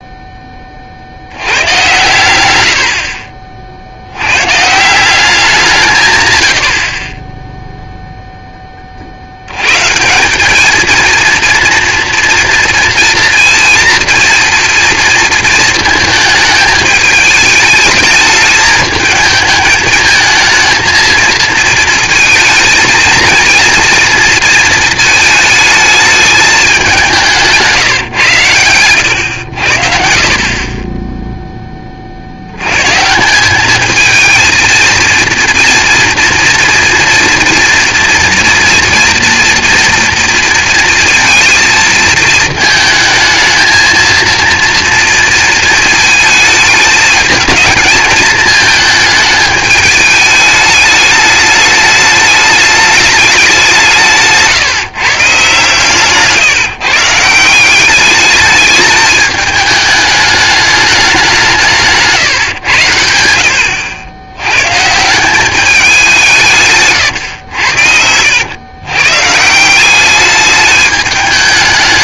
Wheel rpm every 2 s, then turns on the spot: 40, 60, 170, 50, 30, 210, 230, 240, 220, 220, 230, 220, 220, 200, 110, 20, 100, 230, 230, 240, 230, 220, 230, 220, 220, 210, 210, 140, 150, 210, 210, 110, 120, 150, 90, 210.
2-4 28-30